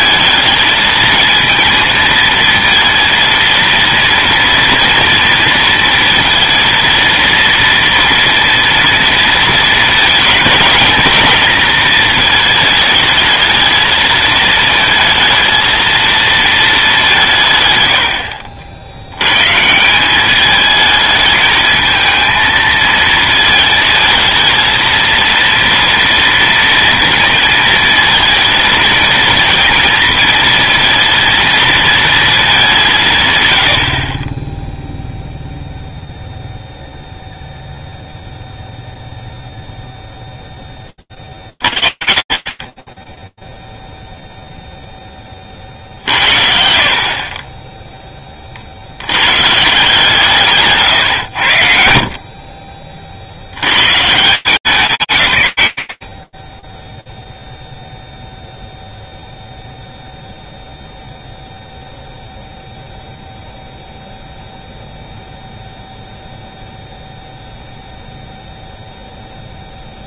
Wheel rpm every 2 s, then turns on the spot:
220, 230, 230, 230, 230, 230, 220, 220, 220, 80, 220, 230, 230, 230, 230, 230, 190, 0, 0, 0, 10, 40, 0, 60, 90, 120, 70, 170, 10, 0, 0, 0, 0, 0, 0.
none